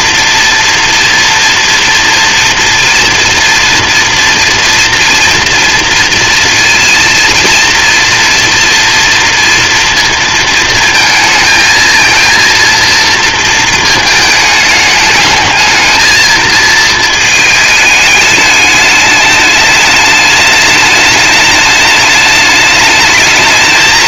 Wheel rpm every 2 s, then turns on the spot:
230, 230, 240, 240, 230, 220, 230, 210, 220, 210, 210, 220.
none